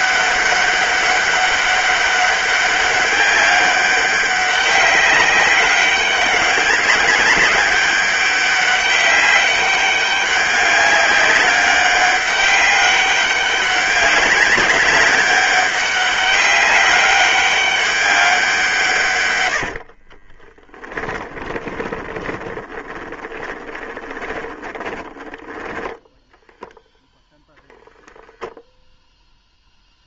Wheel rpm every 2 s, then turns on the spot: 200, 200, 190, 190, 200, 200, 200, 200, 200, 140, 10, 20, 10, 0, 0.
20-26